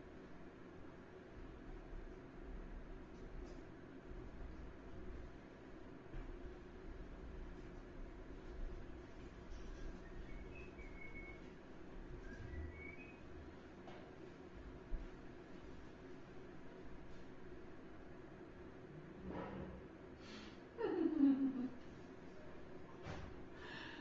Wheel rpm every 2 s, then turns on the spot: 0, 0, 0, 0, 0, 0, 0, 0, 0, 0, 0, 0.
none